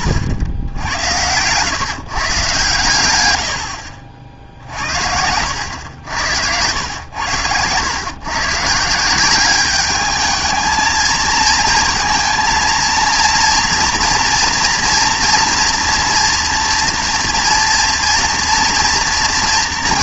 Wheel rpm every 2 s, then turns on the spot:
100, 140, 50, 90, 140, 220, 230, 230, 230, 230.
none